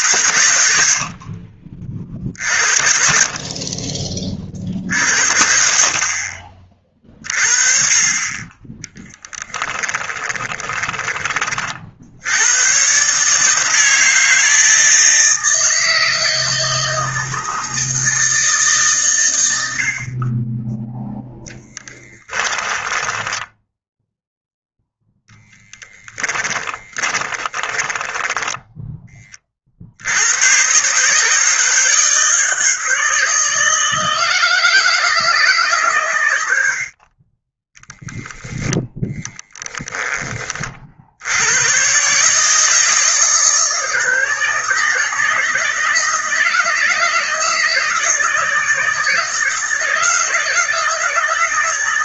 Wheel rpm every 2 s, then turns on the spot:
80, 50, 50, 40, 10, 20, 130, 160, 160, 130, 10, 10, 0, 20, 10, 140, 160, 170, 50, 10, 50, 160, 160, 160, 160, 160.
0-2 10-12 22-24 26-28